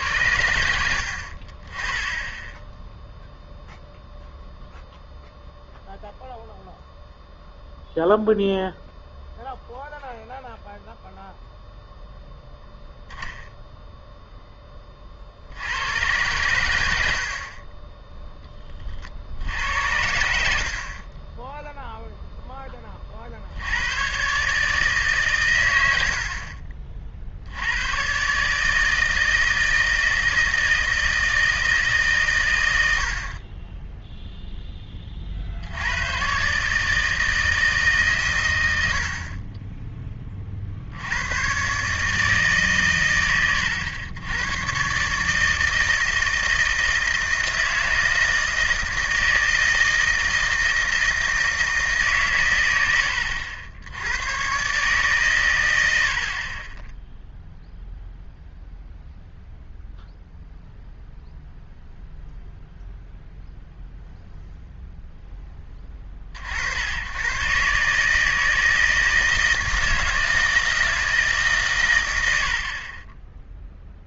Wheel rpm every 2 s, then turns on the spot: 70, 0, 0, 0, 0, 0, 0, 30, 80, 50, 40, 30, 150, 40, 160, 160, 100, 20, 150, 110, 50, 130, 130, 160, 160, 160, 80, 140, 10, 0, 0, 0, 0, 80, 160, 160, 30.
0-2